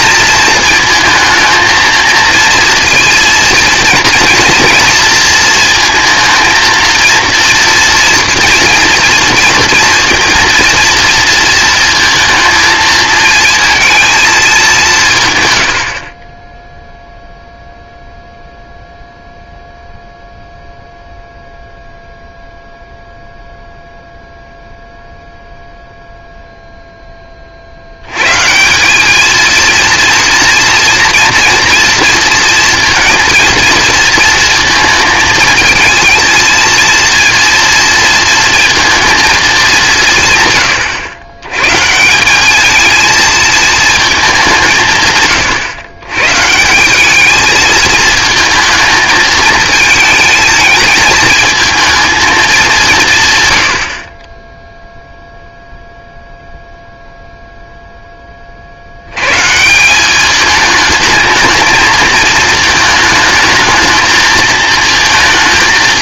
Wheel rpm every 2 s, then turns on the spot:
220, 230, 230, 230, 230, 230, 220, 190, 0, 0, 0, 0, 0, 0, 180, 230, 230, 230, 230, 230, 120, 220, 170, 160, 220, 220, 190, 0, 0, 60, 210, 220, 220.
none